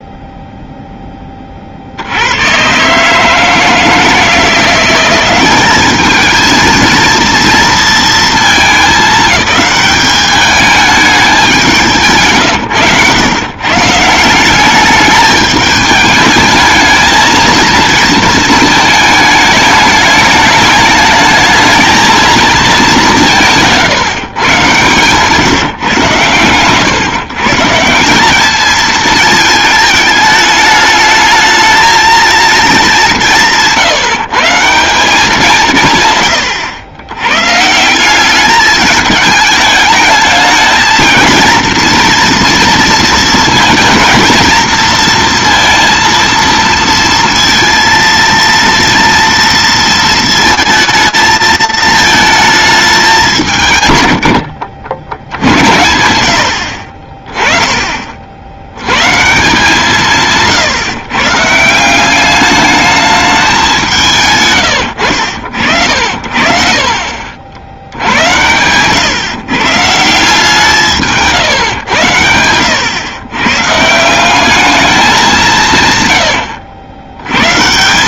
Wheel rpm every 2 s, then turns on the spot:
0, 80, 170, 220, 220, 210, 140, 170, 220, 230, 210, 230, 160, 120, 210, 220, 230, 150, 120, 200, 220, 230, 230, 230, 230, 230, 210, 70, 60, 90, 150, 210, 120, 50, 110, 160, 90, 200, 100.
66-68